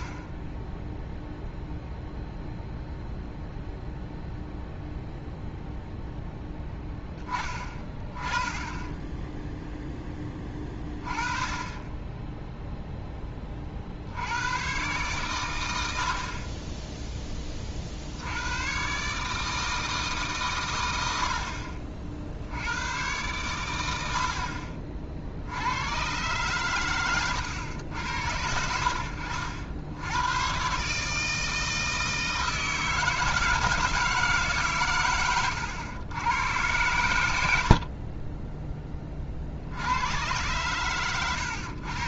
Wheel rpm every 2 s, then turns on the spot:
10, 0, 0, 0, 10, 20, 0, 120, 20, 110, 120, 90, 40, 120, 70, 130, 160, 130, 100, 20, 120.
0-2